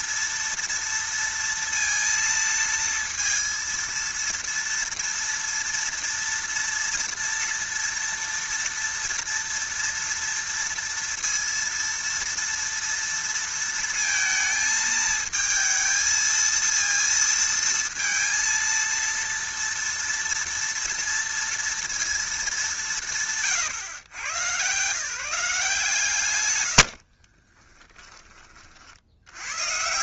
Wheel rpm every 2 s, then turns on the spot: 230, 230, 230, 230, 230, 230, 230, 220, 230, 230, 230, 180, 160, 50, 70.
26-28